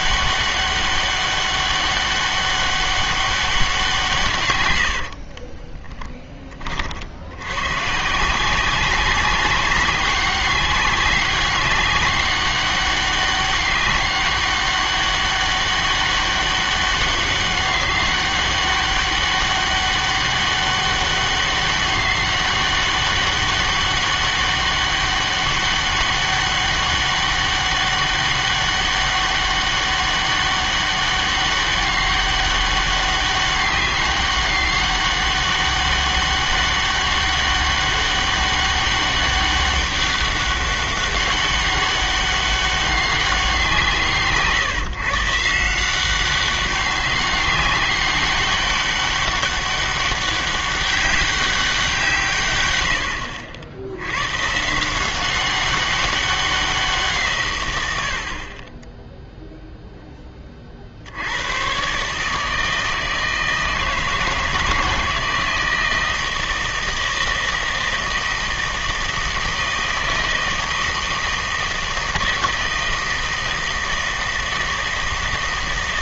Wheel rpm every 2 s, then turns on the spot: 200, 200, 100, 30, 180, 200, 200, 200, 190, 200, 200, 200, 200, 200, 200, 200, 200, 200, 200, 200, 200, 200, 140, 190, 200, 200, 110, 150, 180, 20, 40, 160, 160, 160, 160, 160, 160, 160.
none